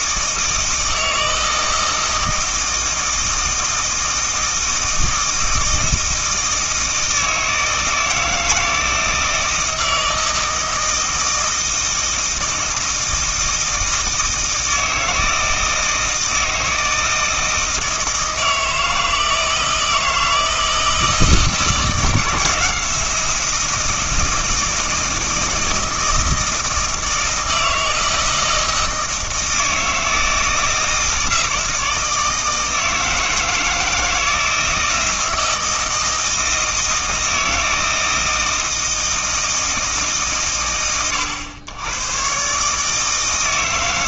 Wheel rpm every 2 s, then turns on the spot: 160, 160, 160, 160, 160, 160, 160, 160, 160, 160, 160, 170, 160, 160, 160, 160, 160, 160, 160, 160, 70, 150.
none